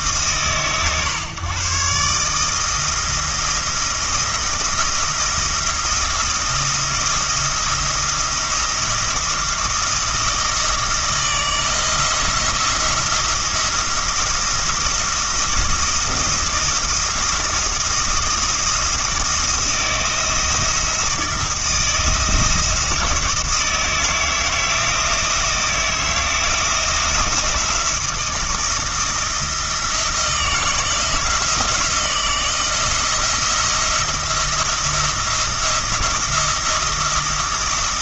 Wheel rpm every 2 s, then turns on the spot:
130, 160, 170, 170, 170, 160, 170, 170, 170, 170, 170, 170, 160, 170, 160, 160, 170, 170, 170.
none